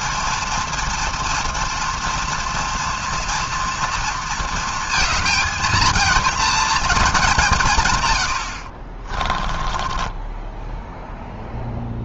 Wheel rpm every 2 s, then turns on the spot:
230, 230, 230, 220, 50, 10.
8-12